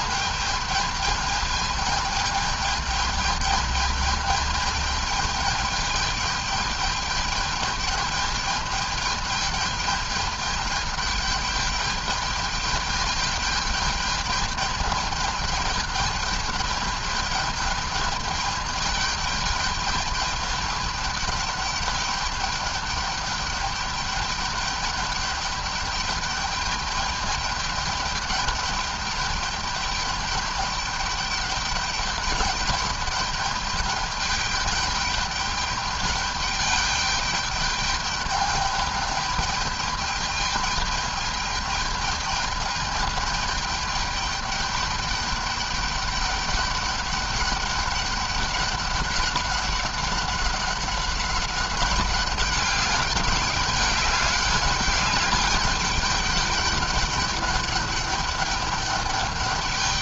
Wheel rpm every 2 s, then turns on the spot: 210, 220, 210, 210, 210, 210, 210, 210, 210, 210, 210, 210, 200, 210, 210, 210, 210, 200, 210, 210, 210, 220, 210, 200, 200, 190, 200, 200, 210, 200.
none